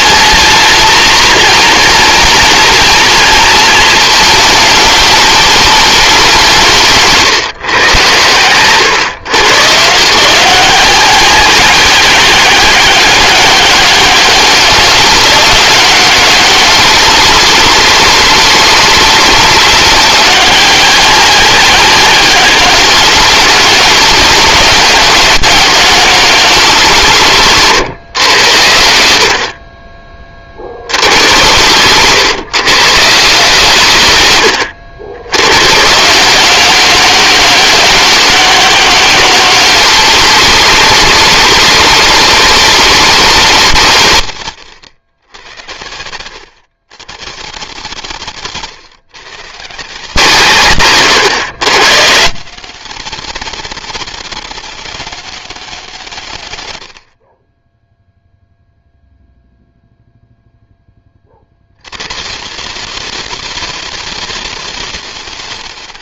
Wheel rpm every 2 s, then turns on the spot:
220, 230, 210, 160, 120, 190, 190, 200, 190, 190, 190, 200, 200, 190, 80, 70, 140, 90, 190, 200, 200, 200, 120, 110, 130, 130, 190, 200, 100, 0, 10, 160, 190.
44-46